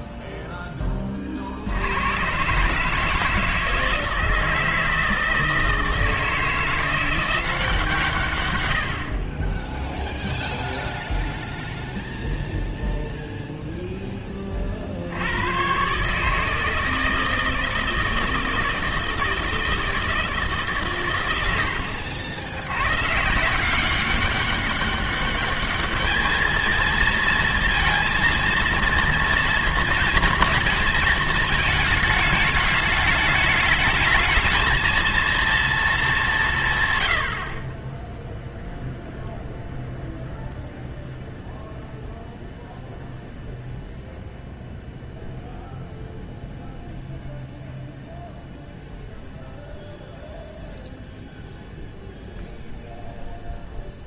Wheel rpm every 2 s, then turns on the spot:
10, 150, 160, 170, 90, 0, 0, 50, 160, 160, 140, 110, 200, 230, 230, 220, 210, 230, 140, 0, 0, 0, 0, 0, 0, 0, 0.
none